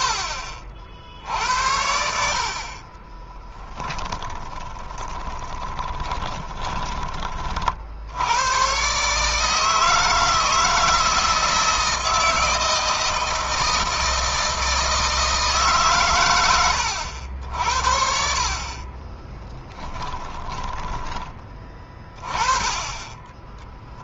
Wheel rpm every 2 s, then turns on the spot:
60, 40, 20, 30, 130, 160, 160, 160, 110, 30, 10, 20.
2-6 18-20